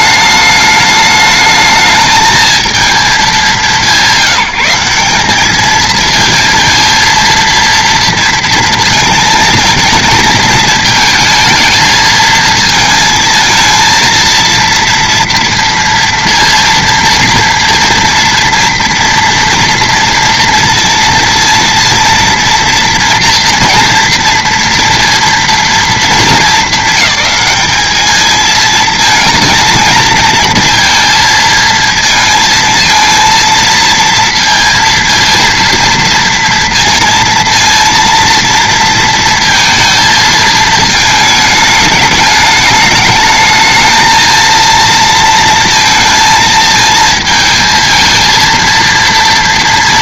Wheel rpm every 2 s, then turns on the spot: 210, 220, 180, 230, 230, 220, 220, 230, 230, 230, 230, 230, 230, 200, 220, 230, 230, 230, 230, 230, 220, 210, 220, 220, 230.
none